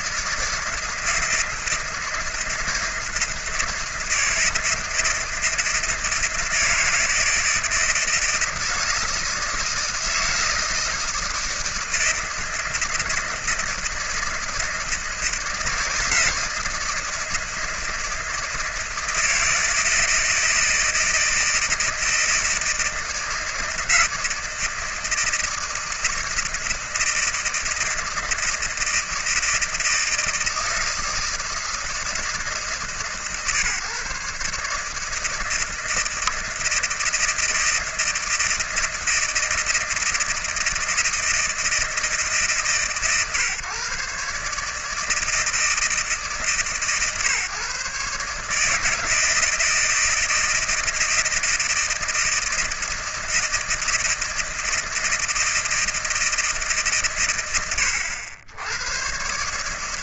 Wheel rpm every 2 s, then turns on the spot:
160, 160, 160, 160, 160, 160, 160, 160, 160, 160, 160, 160, 160, 160, 160, 160, 160, 150, 160, 160, 160, 140, 150, 150, 150, 160, 160, 160, 150, 70.
none